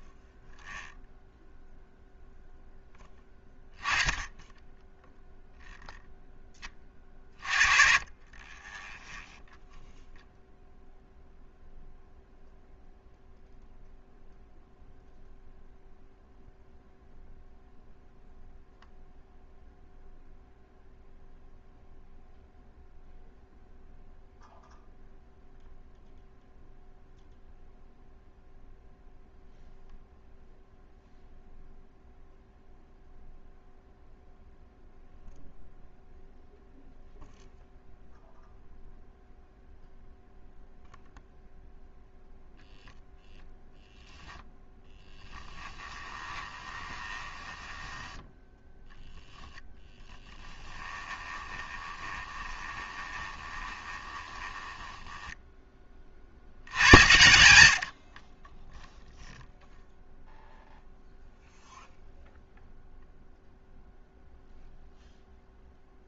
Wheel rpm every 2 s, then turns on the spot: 0, 0, 10, 20, 20, 0, 0, 0, 0, 0, 0, 0, 0, 0, 0, 0, 0, 0, 0, 0, 0, 0, 0, 20, 0, 10, 20, 10, 60, 20, 0, 0, 0.
46-48 50-56